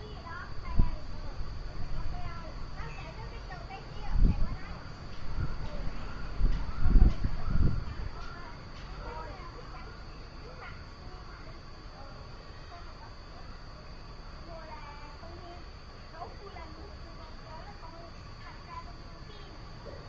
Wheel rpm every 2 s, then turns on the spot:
0, 0, 0, 0, 0, 0, 0, 0, 0, 0.
none